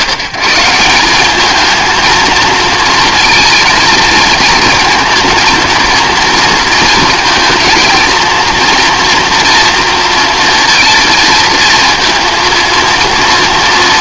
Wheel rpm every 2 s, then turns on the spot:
170, 230, 230, 220, 230, 230, 230.
none